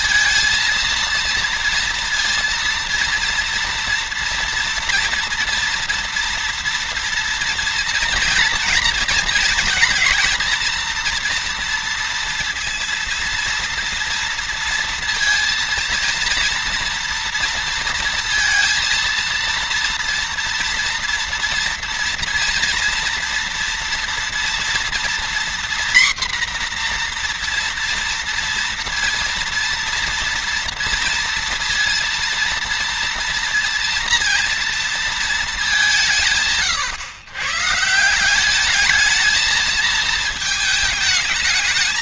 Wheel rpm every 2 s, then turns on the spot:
230, 230, 230, 230, 230, 230, 230, 230, 230, 230, 230, 230, 240, 240, 230, 230, 230, 230, 130, 210, 220.
none